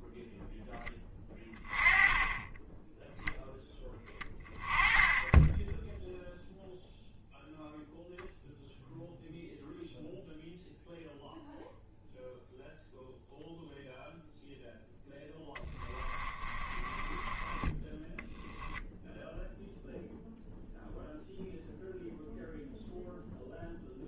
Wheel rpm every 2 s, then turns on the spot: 10, 10, 20, 0, 0, 0, 0, 0, 20, 0, 0, 0.
16-18